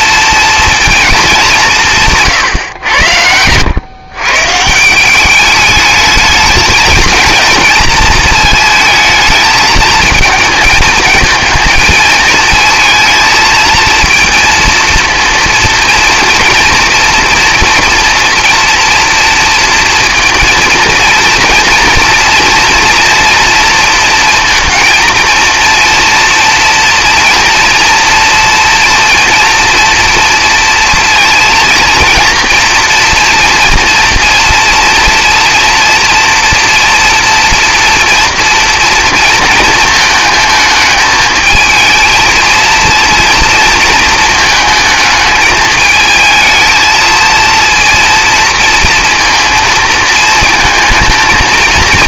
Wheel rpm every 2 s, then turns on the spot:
230, 110, 160, 220, 220, 220, 230, 230, 240, 230, 230, 230, 230, 230, 230, 230, 240, 230, 230, 230, 220, 230, 220, 230, 230, 220.
none